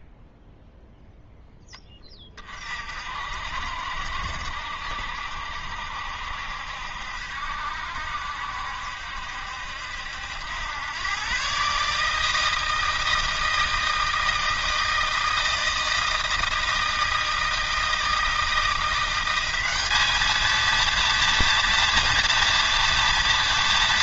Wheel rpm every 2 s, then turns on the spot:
0, 30, 70, 70, 70, 80, 160, 160, 160, 160, 220, 240.
none